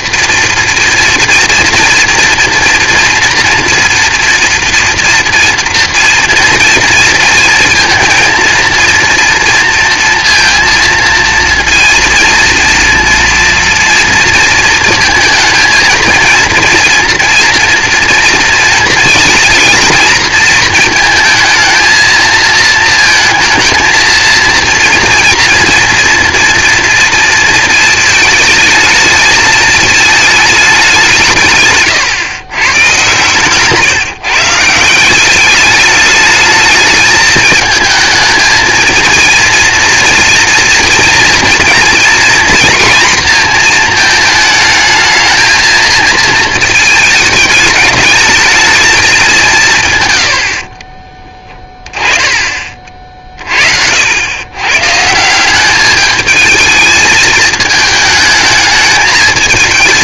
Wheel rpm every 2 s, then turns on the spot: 230, 230, 230, 230, 230, 230, 230, 230, 230, 230, 230, 230, 230, 230, 220, 210, 120, 150, 210, 220, 240, 240, 220, 220, 210, 90, 30, 110, 220, 220.
none